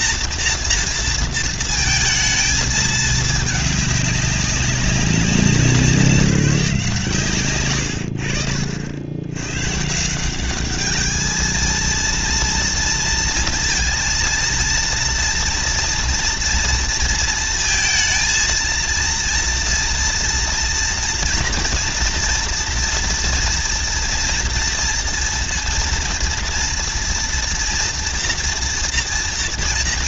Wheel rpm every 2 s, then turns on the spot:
240, 220, 200, 170, 60, 210, 230, 230, 230, 230, 230, 230, 230, 230, 230.
none